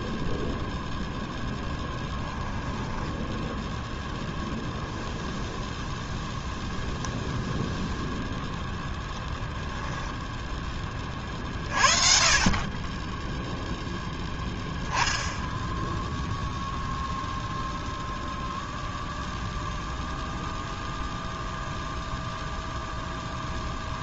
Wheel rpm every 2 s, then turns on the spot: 0, 10, 0, 0, 20, 20, 20, 10, 0, 0, 0, 0.
2-4 8-10